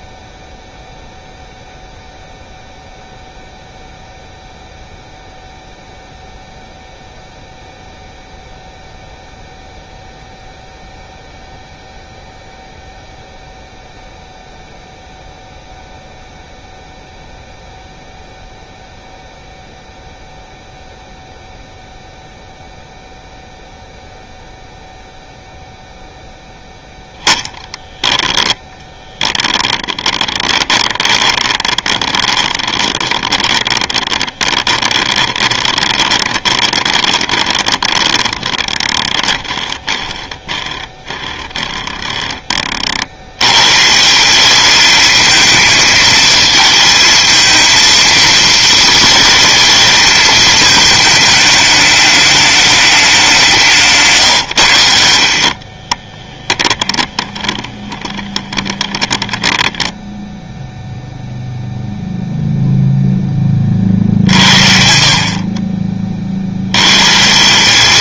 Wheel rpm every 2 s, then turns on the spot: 0, 0, 0, 0, 0, 0, 0, 0, 0, 0, 0, 0, 0, 0, 10, 20, 20, 20, 20, 20, 10, 40, 210, 220, 220, 220, 210, 100, 20, 10, 0, 0, 60, 90.
28-40 56-60